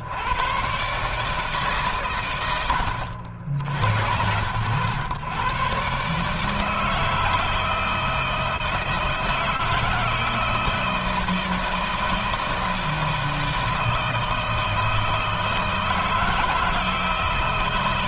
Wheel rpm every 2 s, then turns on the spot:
140, 90, 90, 160, 160, 160, 160, 160, 160.
none